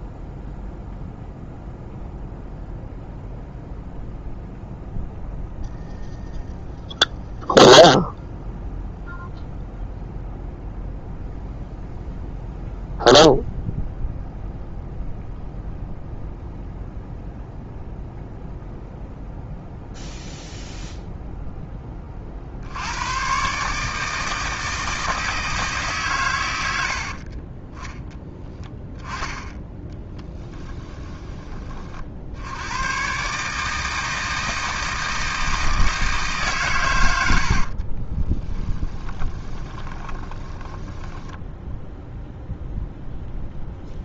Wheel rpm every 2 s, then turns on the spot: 0, 0, 0, 0, 0, 0, 0, 0, 0, 0, 0, 60, 160, 100, 10, 10, 90, 160, 140, 10, 20, 0.
28-32 38-42